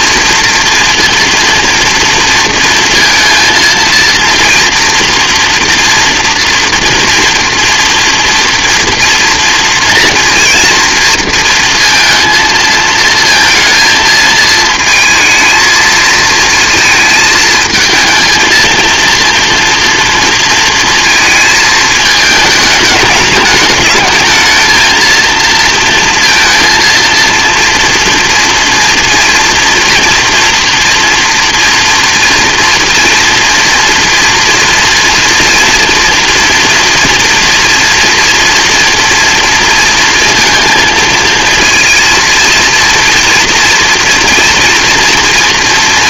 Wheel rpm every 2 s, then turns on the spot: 230, 230, 230, 230, 230, 230, 230, 220, 230, 230, 230, 210, 230, 230, 230, 230, 240, 230, 240, 230, 230, 230, 230.
none